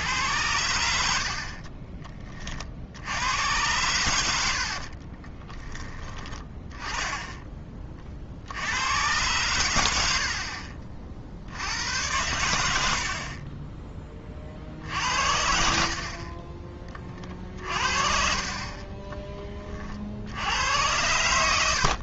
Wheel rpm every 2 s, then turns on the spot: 90, 70, 50, 10, 100, 50, 70, 60, 30, 20, 90.
4-8 14-20